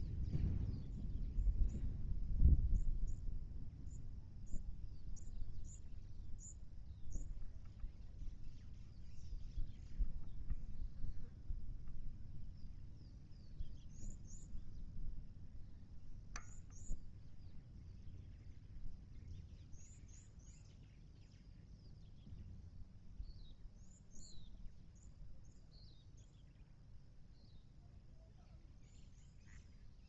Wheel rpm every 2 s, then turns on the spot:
0, 0, 0, 0, 0, 0, 0, 0, 0, 0, 0, 0, 0, 0, 0.
none